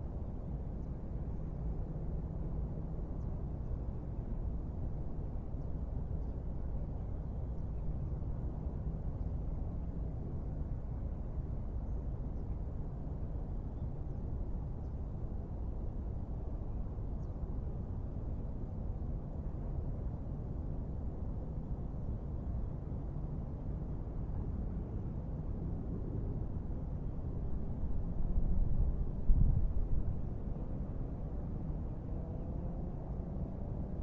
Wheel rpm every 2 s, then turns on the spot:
0, 0, 0, 0, 0, 0, 0, 0, 0, 0, 0, 0, 0, 0, 0, 0, 0.
none